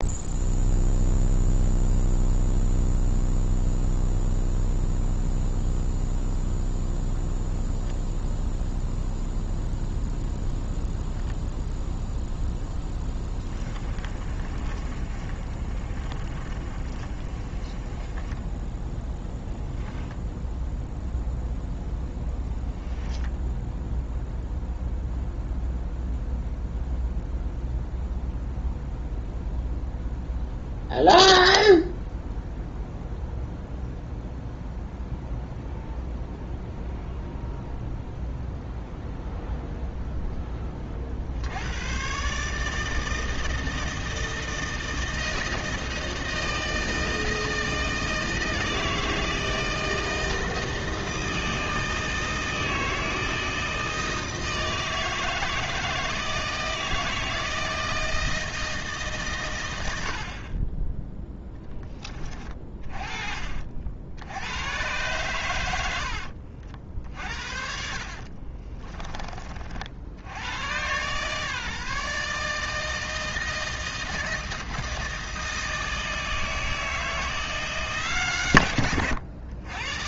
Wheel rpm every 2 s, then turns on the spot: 0, 0, 0, 0, 0, 0, 10, 30, 30, 10, 0, 10, 0, 0, 0, 0, 0, 0, 0, 0, 30, 160, 160, 160, 160, 160, 160, 160, 160, 150, 10, 30, 110, 60, 20, 120, 160, 160, 160, 100.
12-18 22-24 66-70